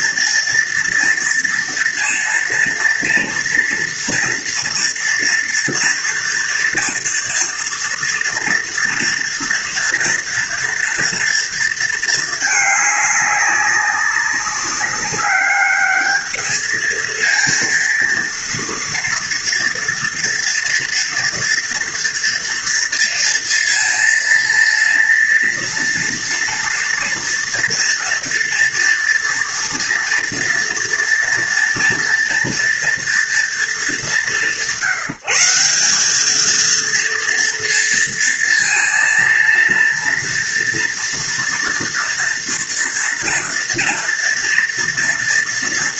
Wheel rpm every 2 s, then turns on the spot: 230, 230, 230, 230, 240, 230, 210, 190, 220, 230, 230, 230, 230, 230, 230, 230, 240, 170, 220, 230, 230, 230, 230.
none